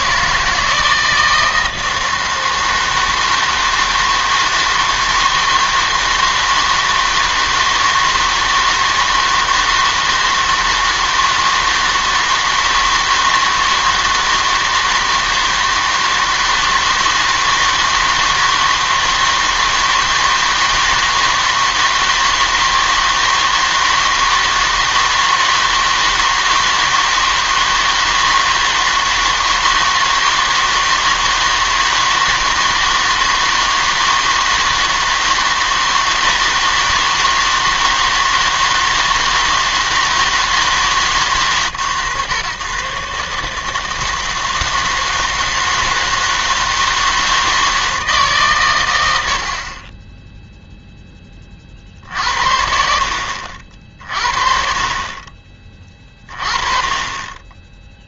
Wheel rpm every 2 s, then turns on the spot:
160, 160, 160, 160, 160, 160, 160, 160, 160, 160, 160, 160, 160, 160, 160, 160, 160, 160, 160, 160, 150, 130, 160, 160, 110, 10, 70, 40, 30.
none